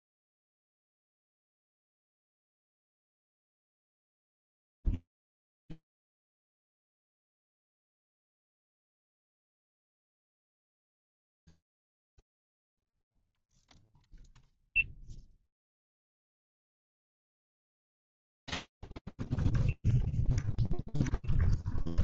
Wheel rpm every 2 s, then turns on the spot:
0, 0, 0, 0, 0, 0, 0, 0, 0, 0, 0.
none